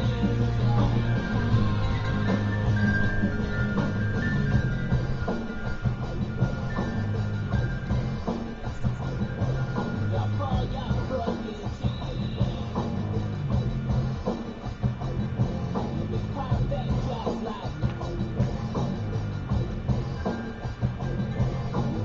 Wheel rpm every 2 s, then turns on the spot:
0, 0, 0, 0, 0, 0, 0, 0, 0, 0, 0.
none